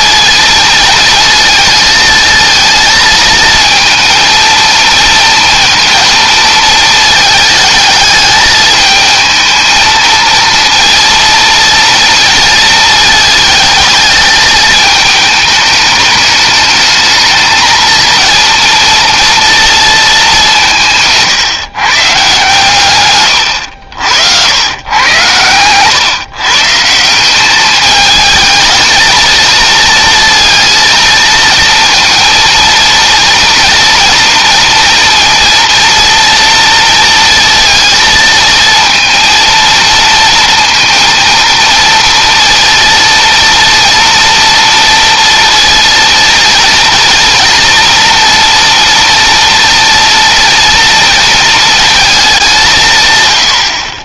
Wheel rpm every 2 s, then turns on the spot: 230, 220, 230, 220, 220, 230, 230, 220, 210, 230, 180, 130, 90, 150, 220, 230, 230, 240, 230, 230, 230, 230, 230, 230, 230, 230, 140.
none